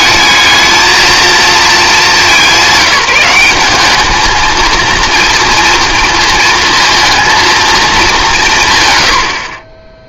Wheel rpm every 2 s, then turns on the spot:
220, 200, 230, 230, 120.
none